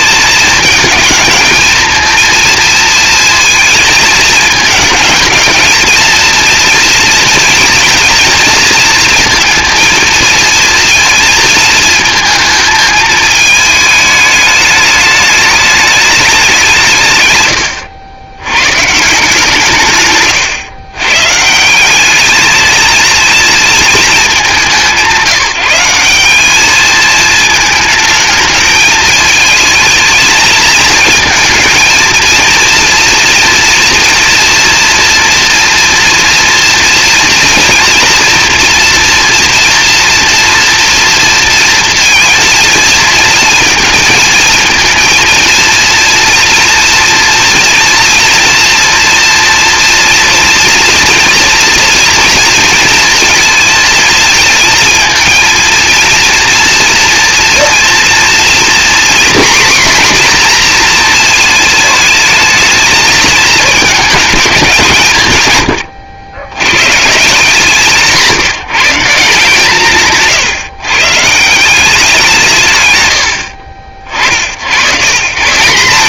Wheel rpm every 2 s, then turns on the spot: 220, 230, 220, 230, 230, 230, 220, 210, 170, 130, 120, 230, 180, 210, 210, 220, 240, 240, 230, 230, 230, 230, 230, 230, 240, 230, 230, 220, 230, 240, 240, 220, 170, 130, 160, 130, 150, 120.
none